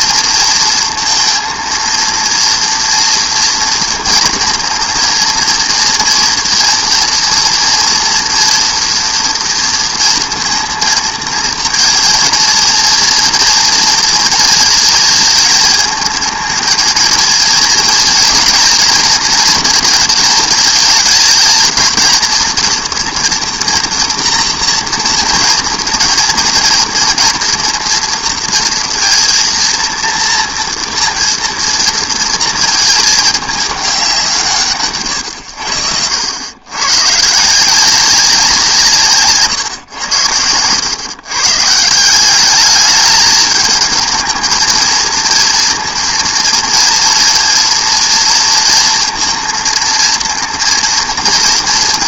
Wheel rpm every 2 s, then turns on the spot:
230, 230, 230, 230, 240, 230, 230, 220, 220, 240, 220, 230, 230, 230, 230, 230, 230, 150, 110, 170, 100, 200, 220, 230, 230, 230.
none